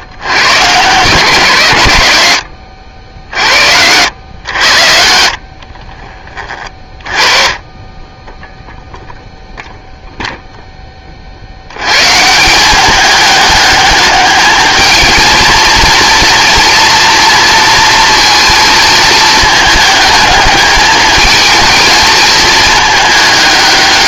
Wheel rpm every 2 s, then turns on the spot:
120, 100, 90, 30, 0, 10, 180, 210, 240, 230, 210, 220.
none